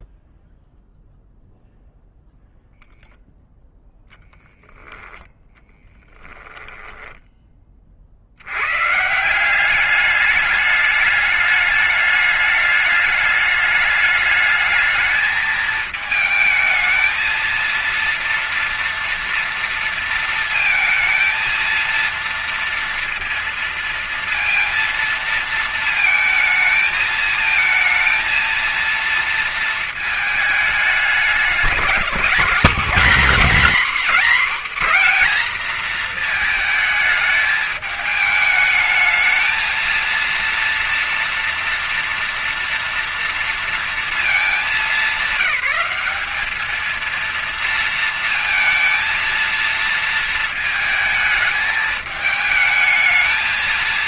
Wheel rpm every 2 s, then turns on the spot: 0, 0, 0, 10, 100, 210, 210, 210, 220, 230, 230, 230, 230, 220, 230, 210, 230, 250, 230, 220, 230, 230, 220, 220, 230, 220, 220.
none